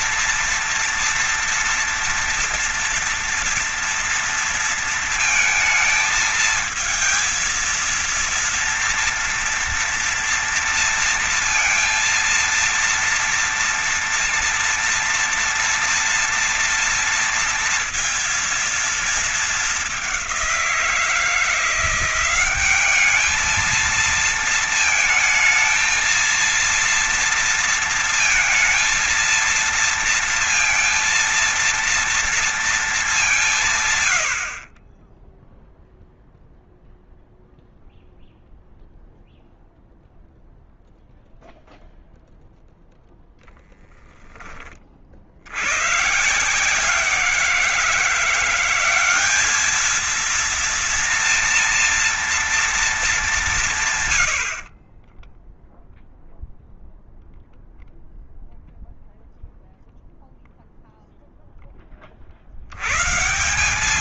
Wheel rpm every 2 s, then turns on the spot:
230, 230, 230, 220, 230, 230, 230, 230, 230, 230, 200, 180, 220, 230, 230, 230, 230, 80, 0, 0, 0, 0, 20, 140, 180, 220, 230, 100, 0, 0, 0, 60.
54-56